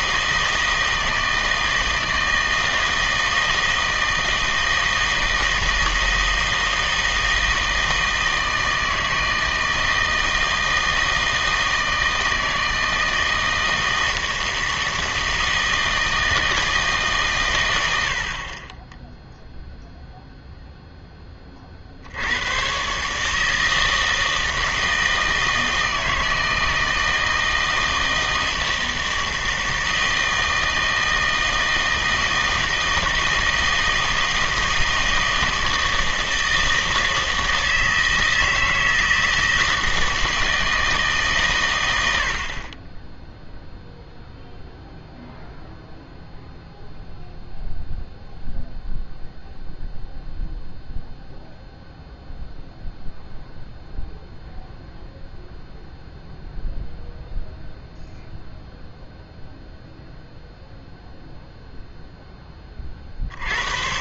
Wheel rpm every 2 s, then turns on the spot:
160, 160, 160, 160, 160, 160, 160, 160, 160, 40, 0, 100, 160, 160, 160, 160, 160, 160, 160, 160, 160, 40, 0, 0, 0, 0, 0, 0, 0, 0, 0, 20.
none